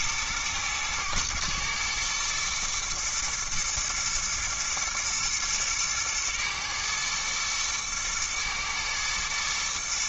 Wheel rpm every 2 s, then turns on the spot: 110, 120, 120, 110, 110.
none